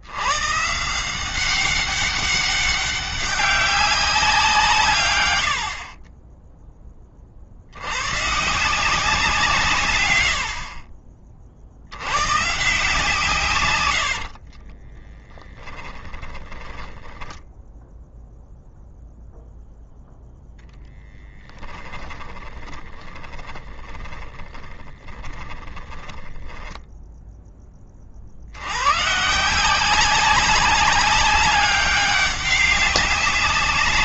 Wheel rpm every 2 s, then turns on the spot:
150, 200, 140, 20, 170, 60, 140, 20, 20, 0, 0, 10, 20, 10, 120, 200, 200.
14-18 22-26